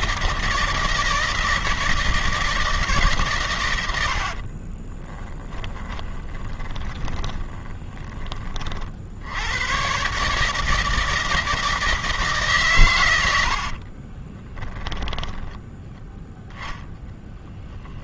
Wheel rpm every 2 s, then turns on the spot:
160, 150, 20, 20, 60, 160, 110, 10, 10.
4-8